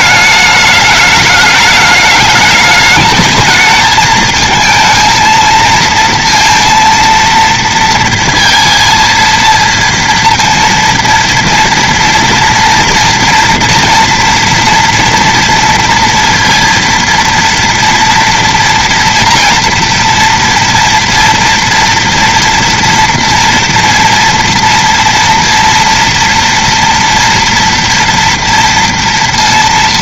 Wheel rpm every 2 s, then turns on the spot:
210, 210, 230, 230, 230, 230, 230, 230, 230, 230, 230, 230, 230, 230, 230.
none